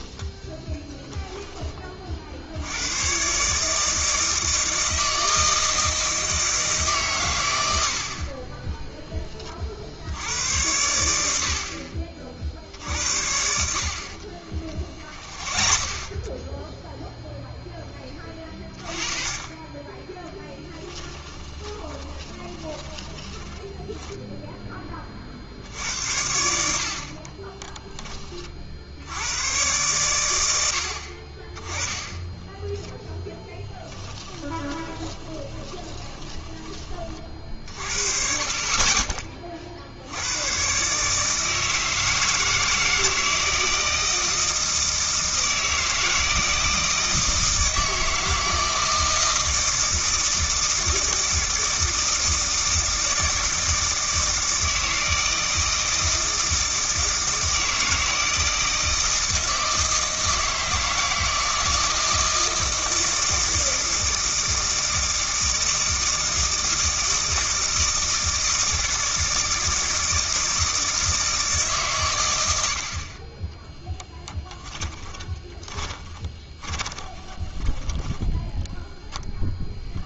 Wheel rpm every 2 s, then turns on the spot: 10, 90, 160, 150, 10, 90, 60, 40, 0, 30, 10, 20, 20, 60, 60, 70, 10, 20, 30, 30, 130, 160, 160, 160, 160, 160, 160, 160, 160, 160, 160, 160, 160, 160, 160, 160, 70, 10, 20, 0.
14-16 20-24 32-36 74-78